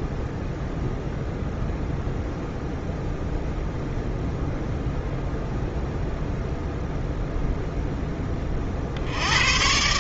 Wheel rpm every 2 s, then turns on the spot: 0, 0, 0, 0, 50.
none